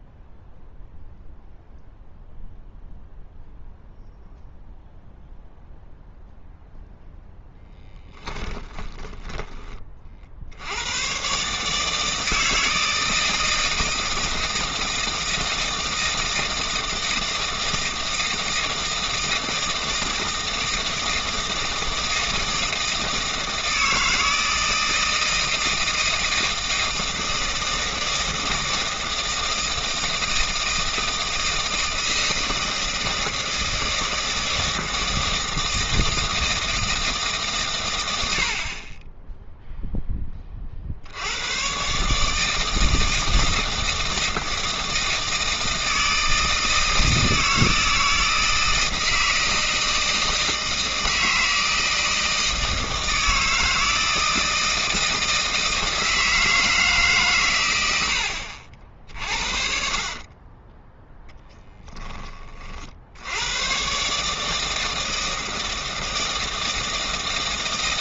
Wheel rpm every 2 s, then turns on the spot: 0, 0, 0, 0, 10, 80, 160, 160, 160, 160, 160, 160, 160, 160, 160, 160, 160, 160, 160, 50, 40, 160, 160, 160, 160, 160, 160, 160, 160, 70, 20, 50, 160, 160.
8-10 58-62